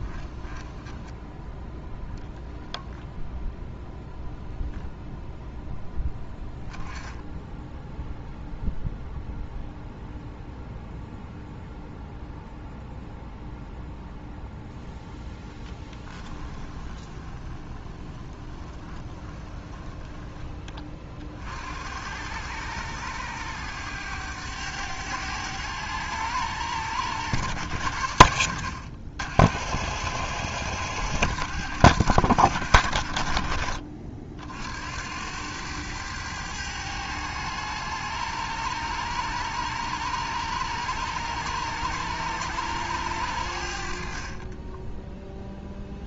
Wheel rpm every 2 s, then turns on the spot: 10, 0, 0, 10, 0, 0, 0, 0, 20, 20, 40, 100, 100, 100, 70, 100, 70, 80, 100, 100, 100, 100, 10.
0-2 16-20 44-46